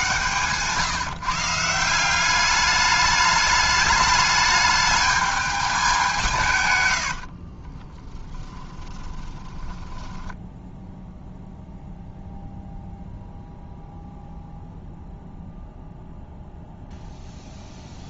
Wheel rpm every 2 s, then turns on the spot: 150, 210, 210, 100, 20, 0, 0, 0, 0.
8-10